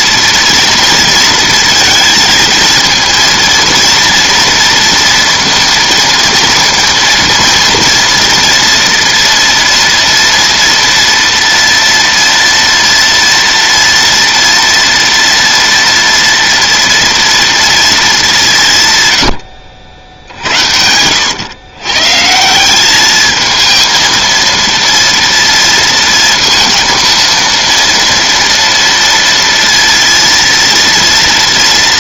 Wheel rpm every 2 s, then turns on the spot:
230, 230, 230, 230, 230, 230, 230, 230, 230, 170, 70, 180, 230, 230, 230, 230.
20-22